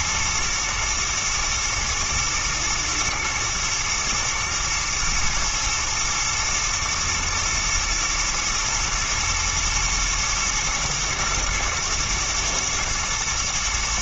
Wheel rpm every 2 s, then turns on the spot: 110, 120, 120, 120, 110, 110, 110.
none